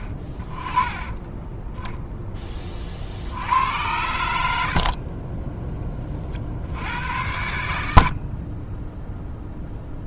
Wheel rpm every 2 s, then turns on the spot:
20, 20, 60, 60, 30.
none